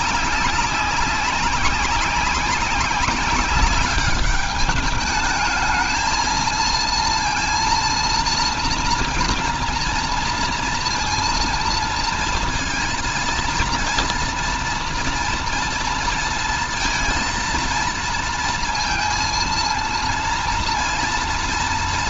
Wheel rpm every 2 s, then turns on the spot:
200, 200, 210, 230, 230, 230, 230, 230, 230, 230, 230.
none